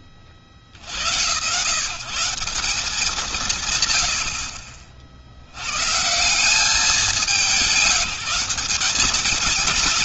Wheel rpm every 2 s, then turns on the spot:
60, 190, 50, 190, 190.
none